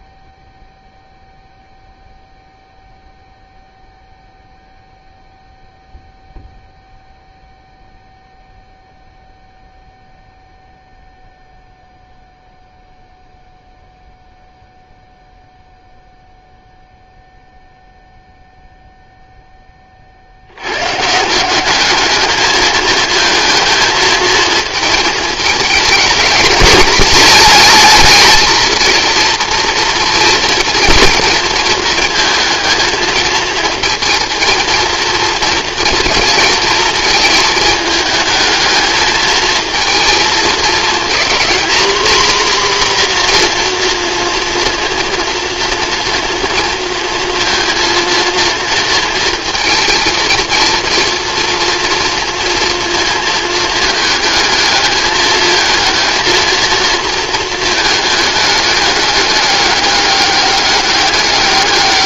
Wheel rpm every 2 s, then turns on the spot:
0, 0, 0, 0, 0, 0, 0, 0, 0, 0, 90, 220, 220, 210, 220, 230, 220, 230, 230, 220, 230, 250, 240, 230, 230, 230, 230, 210, 230, 210, 200.
none